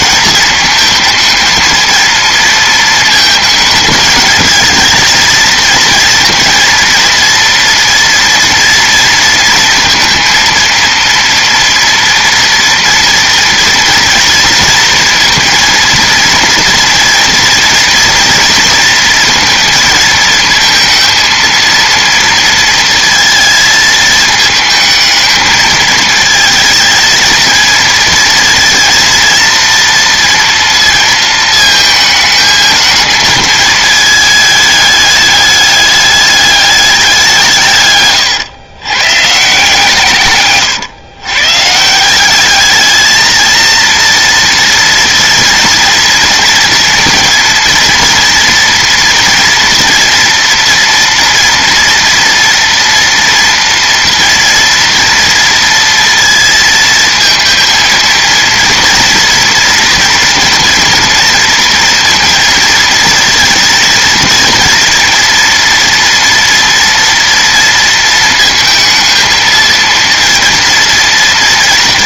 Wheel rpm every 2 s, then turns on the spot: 220, 230, 220, 230, 230, 230, 230, 230, 230, 230, 230, 230, 220, 220, 230, 230, 220, 210, 200, 120, 130, 210, 230, 230, 240, 240, 230, 230, 220, 230, 230, 230, 230, 240, 220, 230.
none